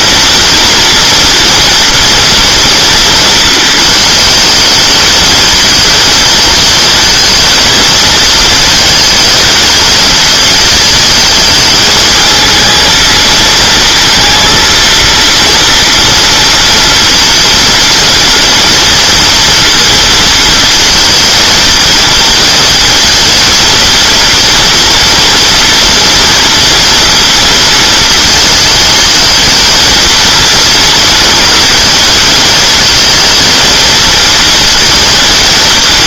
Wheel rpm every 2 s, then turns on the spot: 230, 240, 220, 220, 230, 220, 220, 230, 240, 230, 230, 230, 230, 230, 230, 230, 220, 230.
none